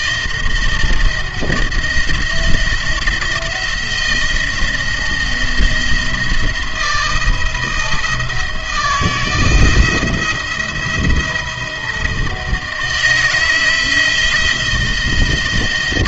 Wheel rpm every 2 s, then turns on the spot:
170, 170, 170, 170, 160, 170, 160, 160.
none